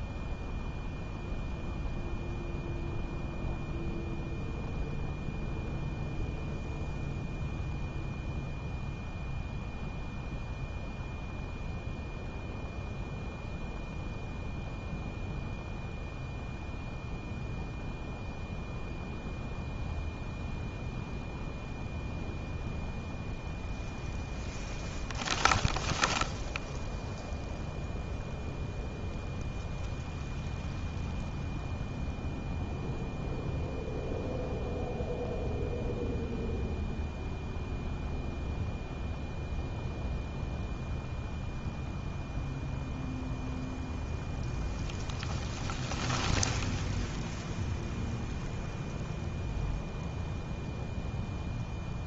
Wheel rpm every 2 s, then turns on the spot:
0, 0, 0, 0, 0, 0, 0, 0, 0, 0, 0, 0, 0, 0, 0, 0, 0, 0, 0, 0, 0, 0, 0, 0, 0, 0.
none